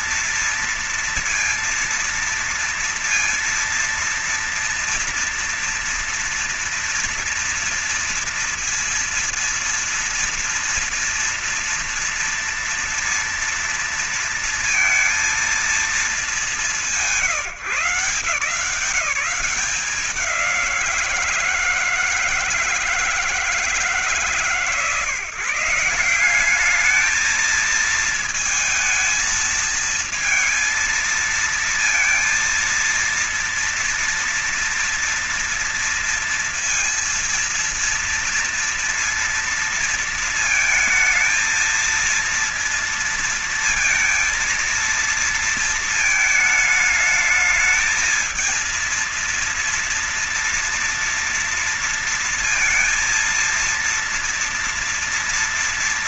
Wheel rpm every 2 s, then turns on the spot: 230, 230, 230, 230, 230, 230, 230, 230, 140, 180, 160, 150, 150, 220, 220, 230, 230, 230, 230, 230, 230, 230, 230, 220, 230, 230, 230, 230.
none